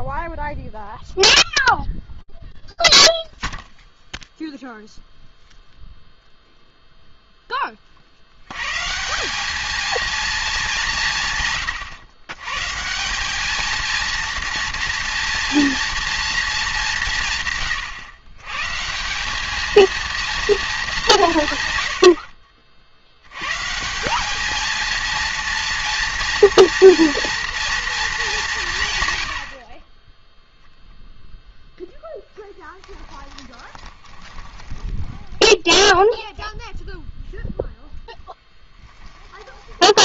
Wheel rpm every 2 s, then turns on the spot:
0, 0, 0, 0, 130, 200, 150, 230, 200, 160, 200, 80, 230, 230, 120, 0, 20, 10, 0, 10.
32-36 38-40